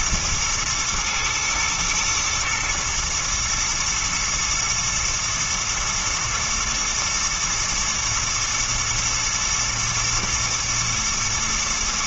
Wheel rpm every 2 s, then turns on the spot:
110, 120, 110, 110, 120, 110.
none